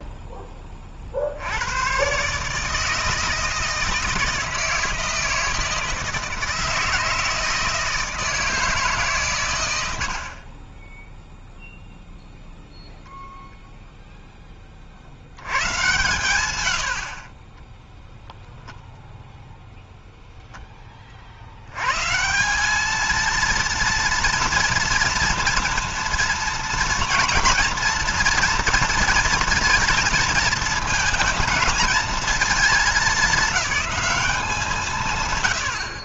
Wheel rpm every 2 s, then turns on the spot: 30, 150, 160, 160, 160, 30, 10, 30, 100, 10, 10, 200, 240, 230, 230, 230, 220, 170.
16-18